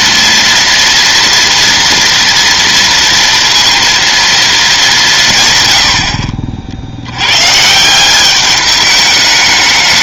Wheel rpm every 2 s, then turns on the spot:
240, 230, 220, 50, 200.
none